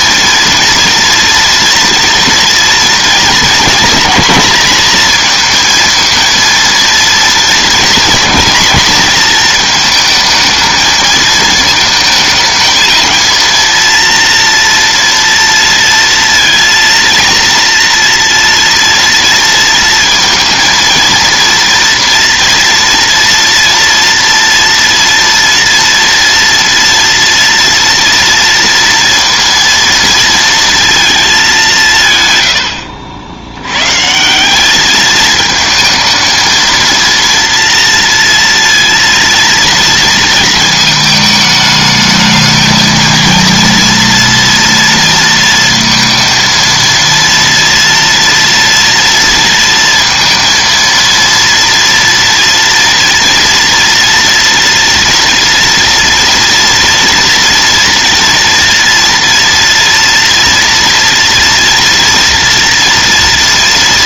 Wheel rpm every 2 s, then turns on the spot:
230, 230, 230, 230, 230, 220, 220, 230, 230, 230, 230, 230, 230, 230, 230, 230, 70, 210, 230, 230, 220, 220, 230, 230, 230, 230, 230, 230, 230, 230, 230, 230.
none